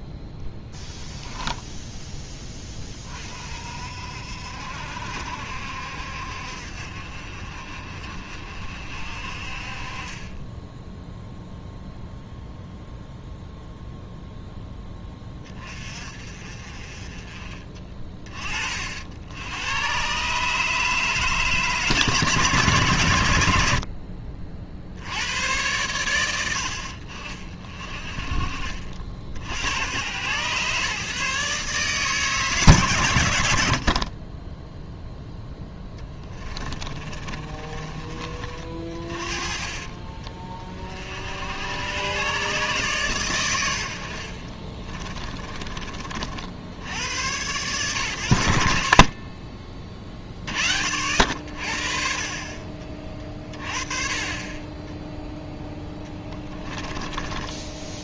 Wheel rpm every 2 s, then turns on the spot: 0, 20, 60, 60, 50, 10, 0, 10, 40, 30, 150, 140, 40, 60, 50, 130, 130, 10, 20, 40, 40, 130, 40, 70, 60, 50, 30, 20, 10.
36-38 44-46 52-54 56-58